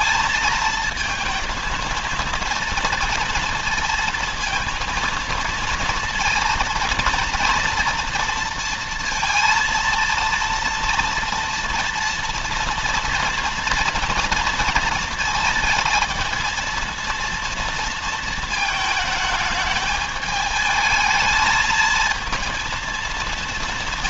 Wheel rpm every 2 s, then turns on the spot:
230, 240, 230, 230, 230, 230, 240, 230, 230, 220, 220, 210.
none